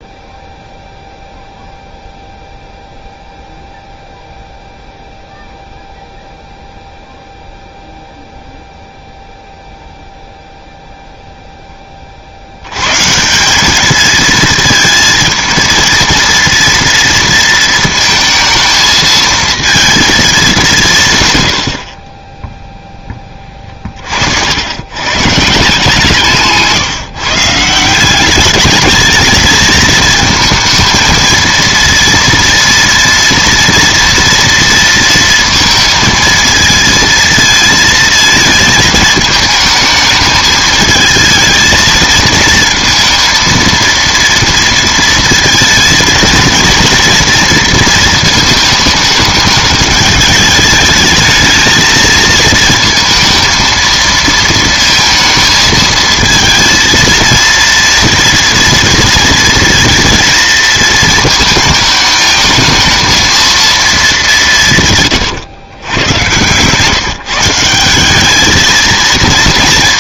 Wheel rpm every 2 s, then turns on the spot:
0, 0, 0, 0, 0, 0, 90, 220, 230, 220, 190, 0, 90, 150, 200, 220, 230, 230, 230, 220, 220, 230, 230, 230, 220, 210, 230, 230, 230, 230, 230, 220, 180, 130, 220.
none